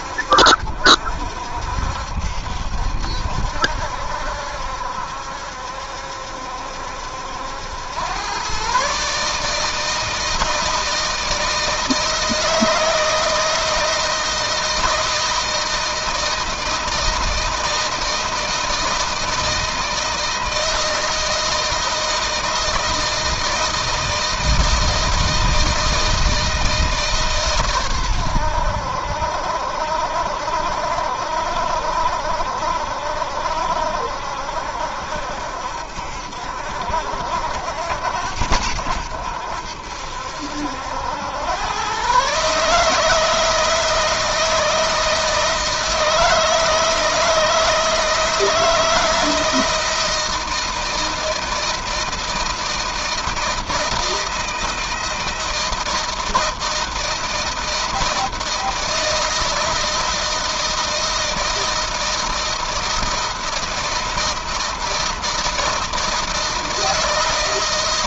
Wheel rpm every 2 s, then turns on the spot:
60, 70, 70, 70, 120, 160, 160, 160, 160, 160, 160, 160, 160, 160, 100, 70, 70, 70, 60, 80, 70, 140, 160, 160, 160, 160, 160, 160, 160, 160, 160, 160, 160, 160.
none